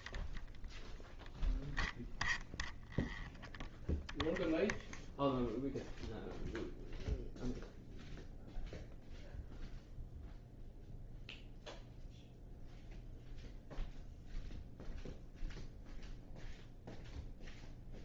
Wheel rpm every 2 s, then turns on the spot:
0, 0, 0, 0, 0, 0, 0, 0, 0.
none